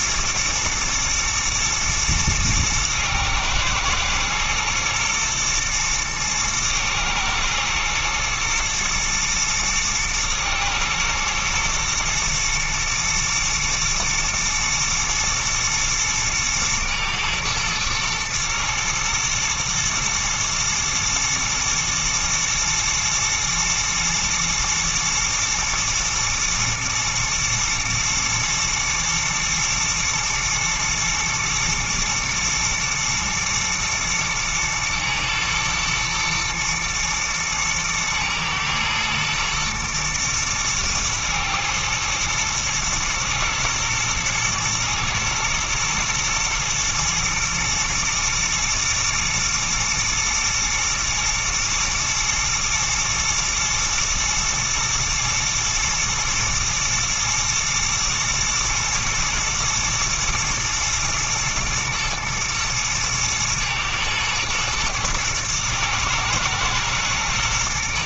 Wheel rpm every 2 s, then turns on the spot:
110, 110, 120, 110, 110, 120, 120, 120, 110, 110, 110, 120, 120, 110, 110, 120, 120, 120, 120, 110, 110, 110, 120, 120, 110, 120, 120, 110, 120, 110, 120, 110, 110, 120.
none